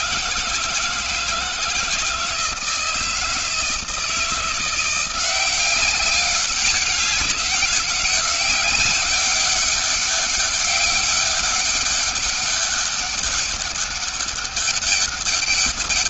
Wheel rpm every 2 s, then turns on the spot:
160, 160, 170, 190, 190, 200, 200, 200.
none